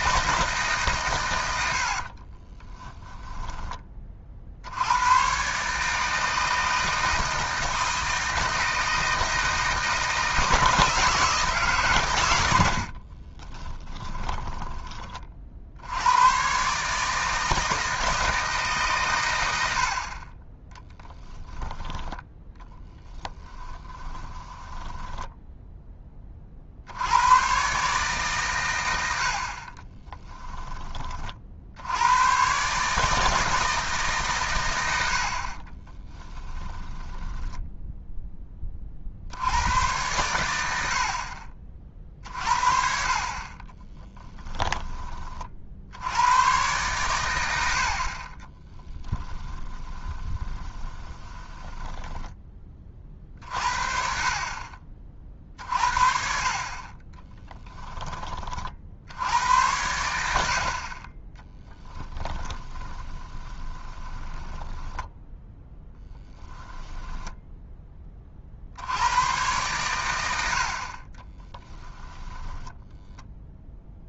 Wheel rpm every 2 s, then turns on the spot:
140, 20, 80, 160, 160, 160, 70, 20, 140, 140, 10, 10, 10, 60, 100, 20, 140, 100, 10, 30, 70, 50, 20, 110, 10, 20, 30, 30, 30, 60, 50, 20, 10, 10, 70, 50, 10.
2-4 12-14 22-26 36-38 48-52 62-66 72-74